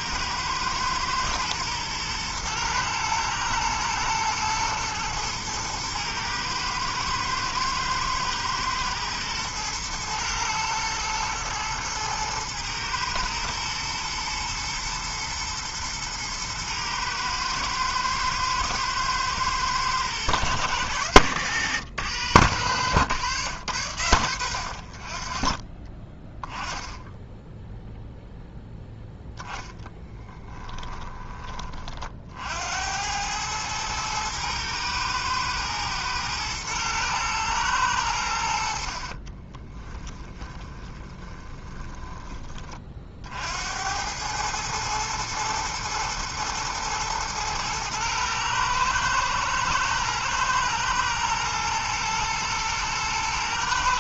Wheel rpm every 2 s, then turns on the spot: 110, 110, 110, 110, 120, 110, 110, 120, 120, 120, 110, 110, 60, 10, 0, 20, 80, 110, 110, 50, 20, 30, 110, 110, 110, 110, 110.
30-32 40-42